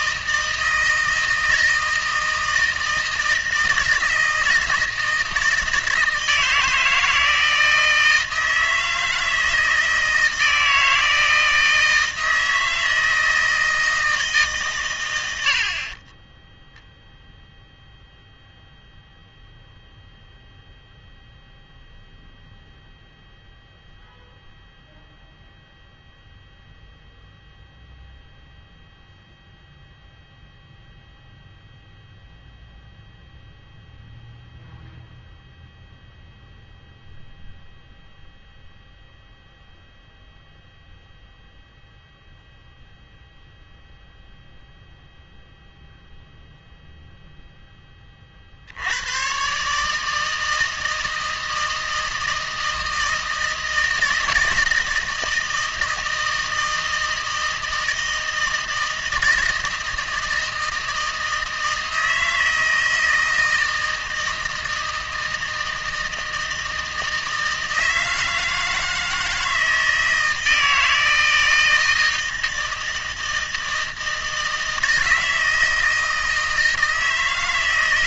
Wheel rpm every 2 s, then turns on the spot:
160, 160, 160, 160, 160, 160, 160, 140, 0, 0, 0, 0, 0, 0, 0, 0, 0, 0, 0, 0, 0, 0, 0, 0, 80, 160, 160, 160, 160, 160, 160, 160, 160, 160, 160, 160, 160, 160, 160.
none